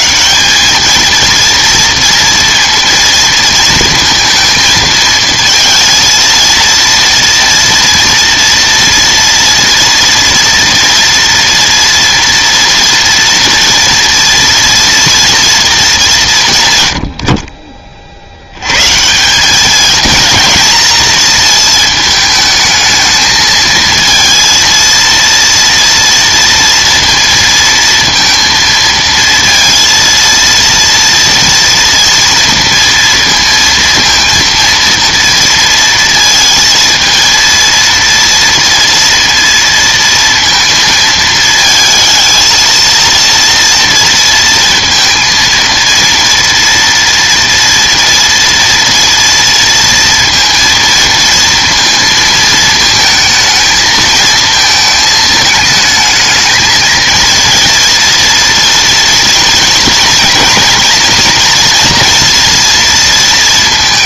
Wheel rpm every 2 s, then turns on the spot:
190, 230, 230, 230, 230, 240, 230, 230, 130, 130, 230, 220, 230, 230, 230, 230, 230, 230, 230, 230, 220, 230, 230, 240, 230, 230, 220, 220, 220, 230, 230, 230.
none